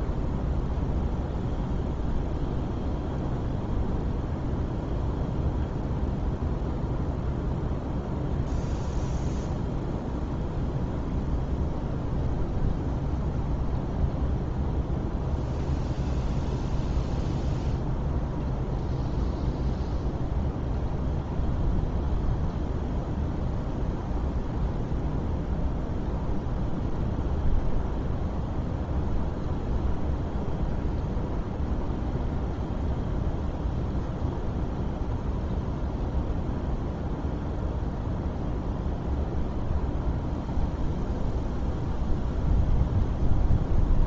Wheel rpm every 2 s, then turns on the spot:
0, 0, 0, 0, 0, 0, 0, 0, 0, 0, 0, 0, 0, 0, 0, 0, 0, 0, 0, 0, 0, 0.
none